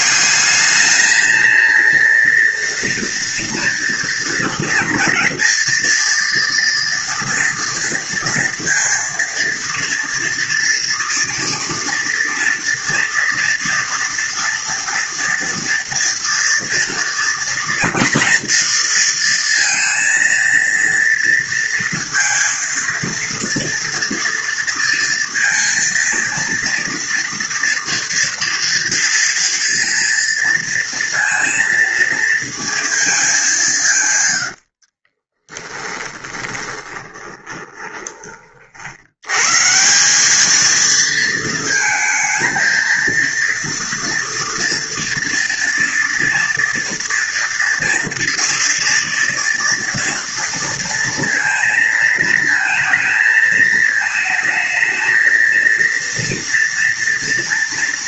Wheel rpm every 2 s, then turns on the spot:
200, 230, 230, 230, 230, 240, 230, 230, 230, 230, 230, 230, 230, 230, 230, 230, 230, 90, 20, 40, 210, 230, 230, 230, 230, 230, 230, 220, 230.
34-38